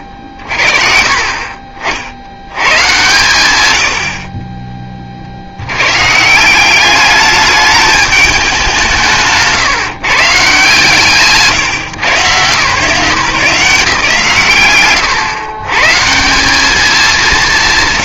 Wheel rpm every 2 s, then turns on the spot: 40, 120, 30, 190, 190, 150, 160, 120, 190.
none